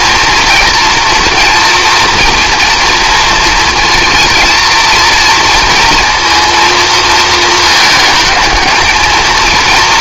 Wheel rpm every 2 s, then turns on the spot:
230, 240, 230, 230, 220.
none